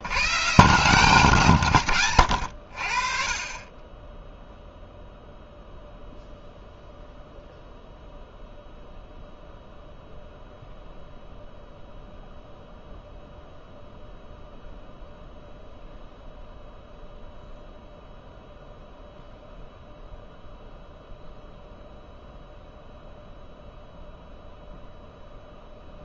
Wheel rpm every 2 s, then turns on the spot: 110, 110, 10, 0, 0, 0, 0, 0, 0, 0, 0, 0, 0.
none